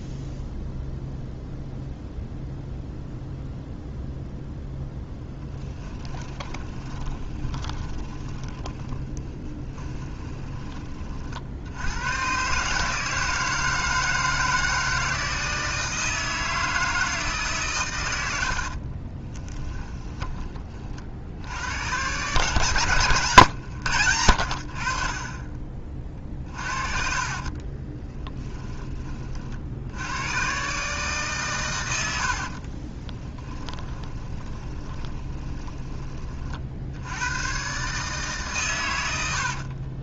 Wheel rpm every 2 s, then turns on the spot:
0, 0, 0, 20, 10, 30, 150, 160, 160, 40, 40, 130, 40, 50, 30, 140, 40, 20, 70, 100.
6-10 18-20 26-28 32-36